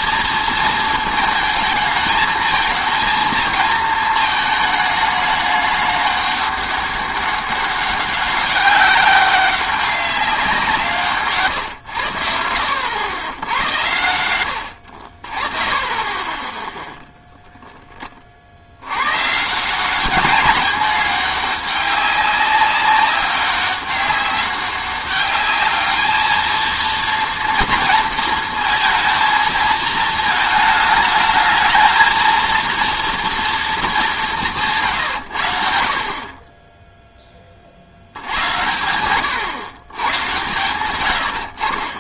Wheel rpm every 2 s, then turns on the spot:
230, 230, 220, 200, 190, 180, 70, 100, 10, 70, 210, 200, 200, 230, 230, 220, 230, 170, 20, 90, 120.
none